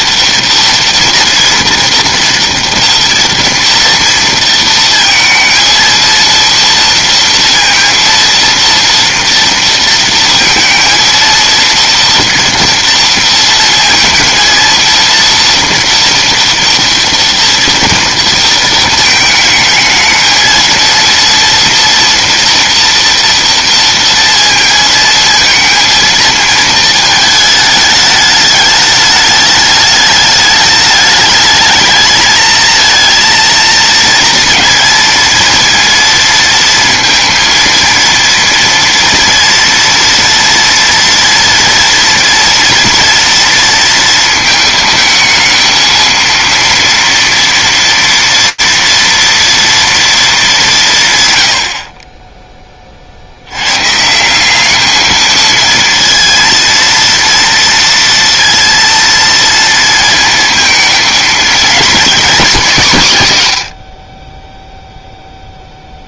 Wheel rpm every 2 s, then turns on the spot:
230, 230, 230, 230, 230, 230, 230, 230, 230, 230, 230, 240, 230, 230, 210, 210, 220, 230, 220, 230, 230, 230, 220, 230, 230, 190, 20, 200, 230, 230, 230, 200, 0.
none